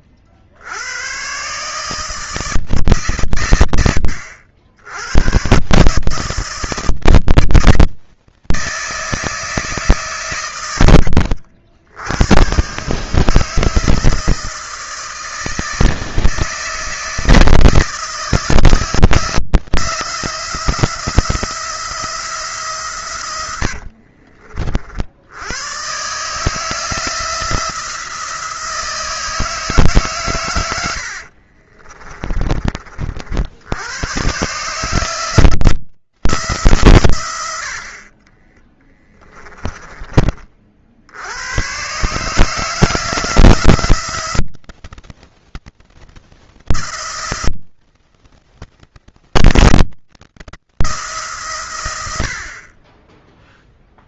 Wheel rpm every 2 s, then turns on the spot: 100, 150, 80, 160, 160, 90, 140, 160, 160, 160, 170, 150, 50, 160, 160, 90, 40, 150, 140, 10, 50, 160, 170, 170, 170, 160, 30.
38-40